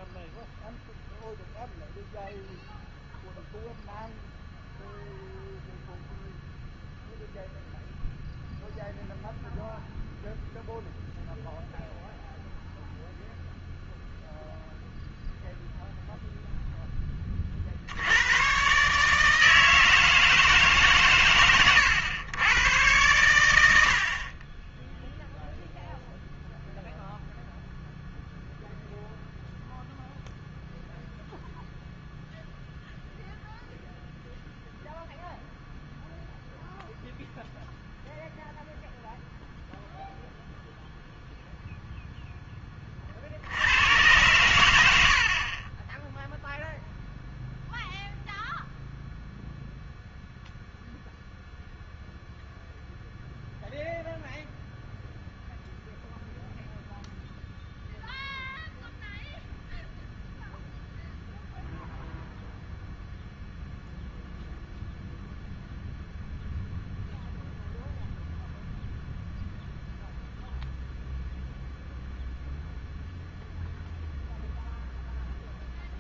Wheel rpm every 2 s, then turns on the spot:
0, 0, 0, 0, 0, 0, 0, 0, 10, 140, 140, 110, 10, 0, 0, 0, 0, 0, 0, 0, 0, 20, 90, 0, 0, 0, 0, 0, 0, 0, 0, 0, 0, 0, 0, 0, 0, 0.
none